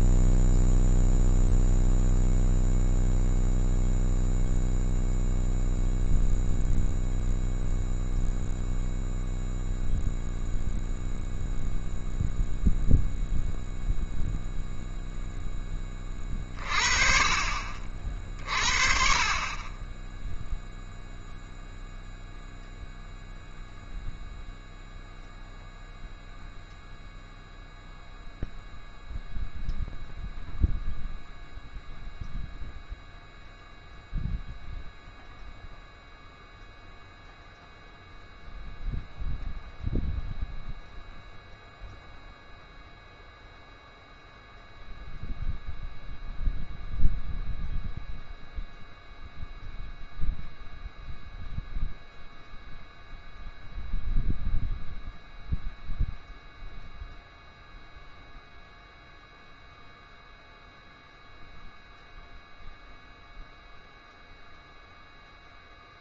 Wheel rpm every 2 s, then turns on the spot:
0, 0, 0, 0, 0, 0, 0, 0, 30, 40, 0, 0, 0, 0, 0, 0, 0, 0, 0, 0, 0, 0, 0, 0, 0, 0, 0, 0, 0, 0, 0, 0, 0.
none